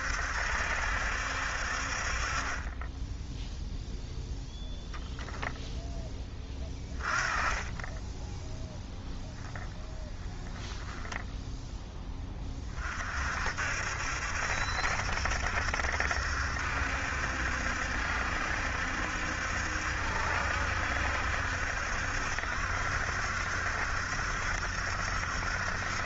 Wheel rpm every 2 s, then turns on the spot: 70, 20, 0, 20, 0, 10, 30, 70, 70, 70, 70, 70, 70.
none